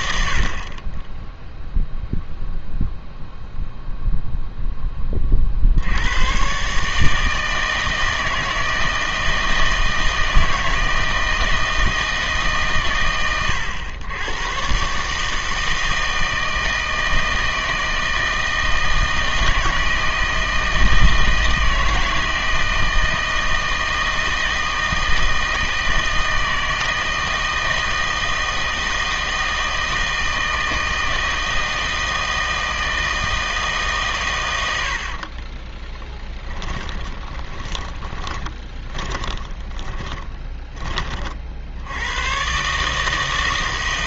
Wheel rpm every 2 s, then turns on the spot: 40, 0, 10, 140, 160, 160, 140, 120, 160, 160, 160, 160, 160, 160, 160, 160, 160, 90, 20, 20, 20, 130.
36-40